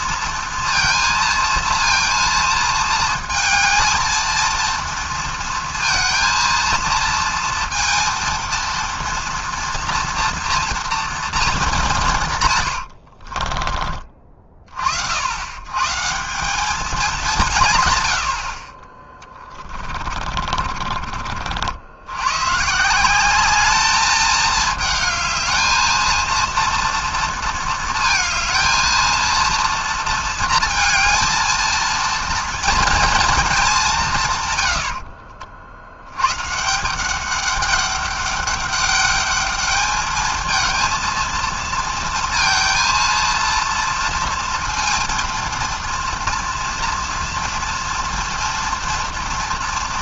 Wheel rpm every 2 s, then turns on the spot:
230, 230, 230, 230, 230, 240, 110, 40, 200, 30, 40, 150, 220, 230, 230, 230, 230, 90, 160, 200, 230, 230, 230, 230, 230.
12-14